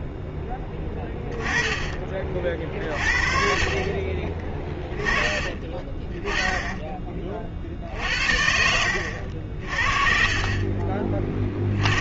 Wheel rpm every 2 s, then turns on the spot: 10, 50, 20, 20, 70, 40.
4-6 8-10